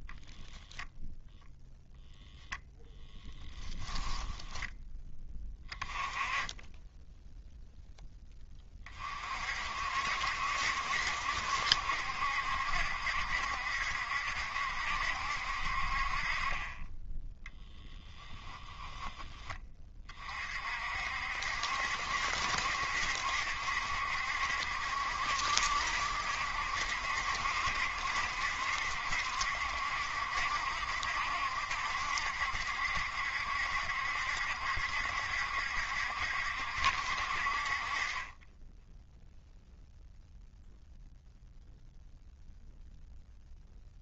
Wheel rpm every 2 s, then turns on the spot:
0, 0, 10, 10, 20, 70, 70, 70, 30, 20, 50, 70, 70, 70, 70, 70, 70, 70, 70, 10, 0, 0.
18-20